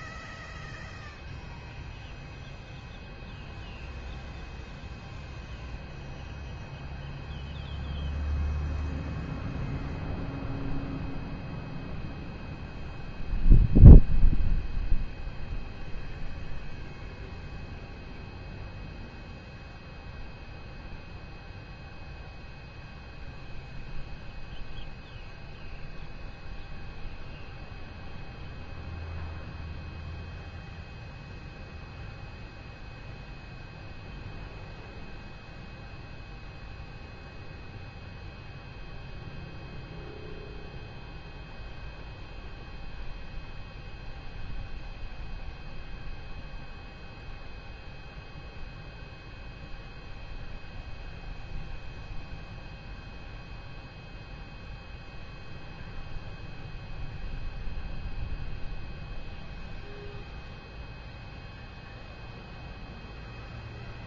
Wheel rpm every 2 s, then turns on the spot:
0, 0, 0, 0, 0, 0, 0, 0, 0, 0, 0, 0, 0, 0, 0, 0, 0, 0, 0, 0, 0, 0, 0, 0, 0, 0, 0, 0, 0, 0, 0, 0.
none